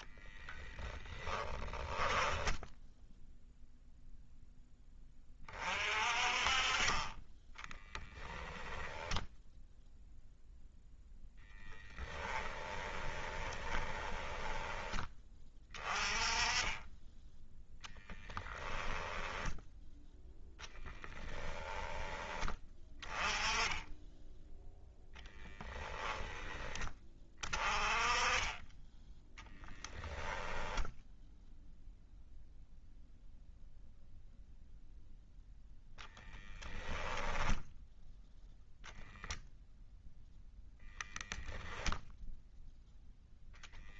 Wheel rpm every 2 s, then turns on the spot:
10, 10, 20, 30, 10, 0, 20, 20, 10, 10, 10, 20, 0, 20, 10, 0, 0, 0, 0, 0, 0, 0.
0-2 8-10 12-14 20-22